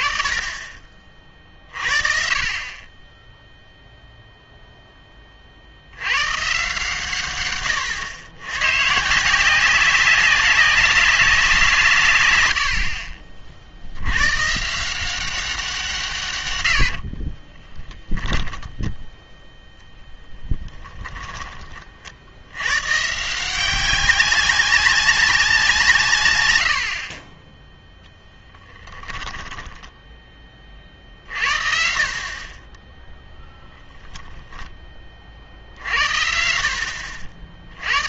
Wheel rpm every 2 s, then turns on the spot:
30, 30, 0, 140, 130, 200, 60, 150, 100, 10, 20, 110, 200, 70, 10, 30, 20, 10, 70.
16-18 20-22 28-30